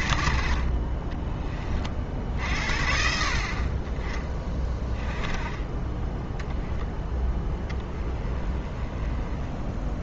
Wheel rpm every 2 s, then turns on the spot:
40, 50, 20, 0, 10.
0-2